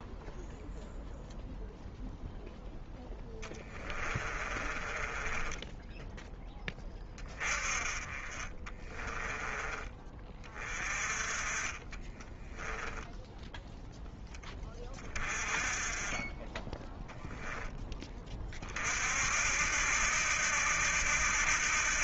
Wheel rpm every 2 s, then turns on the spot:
0, 0, 20, 20, 20, 20, 10, 10, 10, 30, 80.
4-6 8-10 12-14